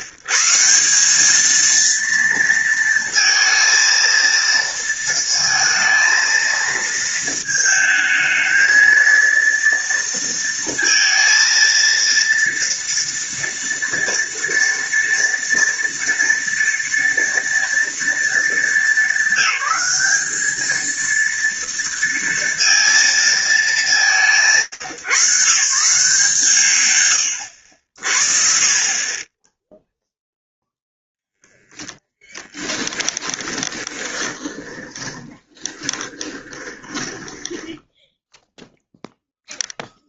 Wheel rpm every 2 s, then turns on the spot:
200, 230, 230, 220, 220, 230, 230, 230, 230, 190, 230, 230, 160, 110, 40, 0, 20, 20, 20, 20.
32-38